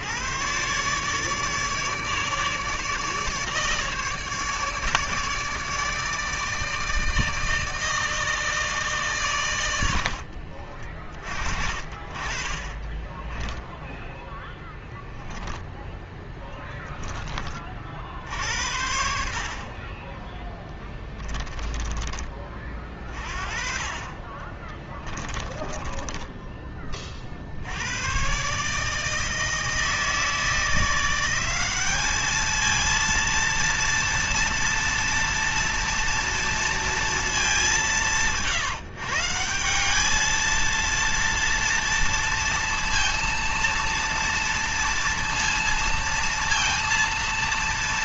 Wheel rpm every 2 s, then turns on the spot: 130, 150, 150, 160, 140, 30, 20, 10, 10, 60, 10, 30, 20, 20, 150, 170, 230, 230, 230, 150, 230, 230, 230, 230.
12-16 20-22 24-26